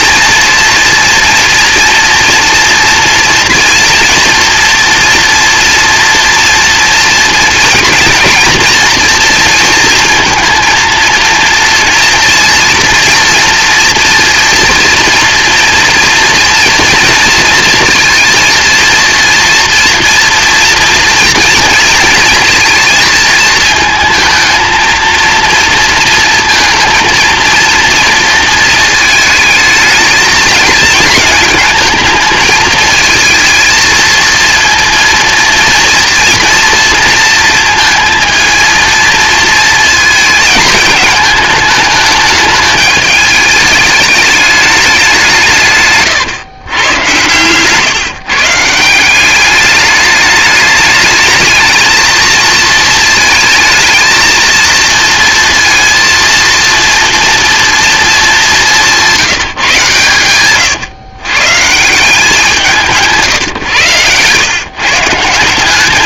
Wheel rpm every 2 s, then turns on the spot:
230, 230, 230, 230, 230, 230, 230, 230, 230, 230, 230, 230, 220, 230, 230, 210, 220, 230, 230, 220, 220, 210, 210, 110, 160, 210, 220, 220, 230, 200, 120, 170, 140.
60-62